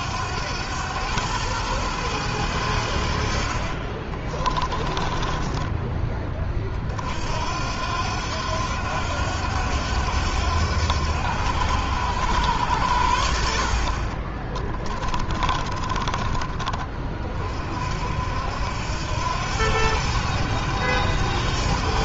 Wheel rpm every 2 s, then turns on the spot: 100, 80, 20, 40, 90, 90, 90, 20, 30, 80, 100.
2-6 14-16